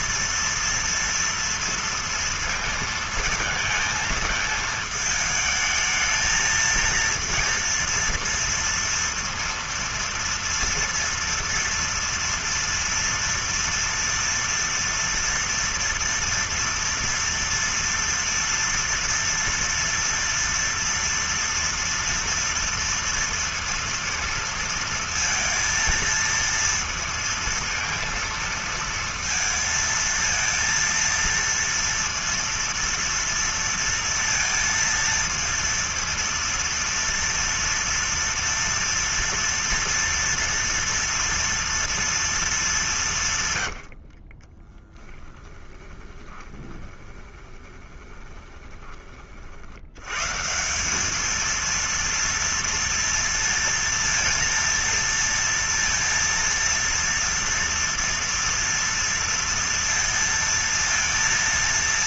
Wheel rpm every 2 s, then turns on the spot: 230, 230, 220, 230, 230, 230, 230, 230, 230, 230, 230, 230, 230, 230, 230, 230, 230, 230, 230, 230, 230, 210, 20, 20, 20, 190, 230, 230, 230, 230, 230.
44-48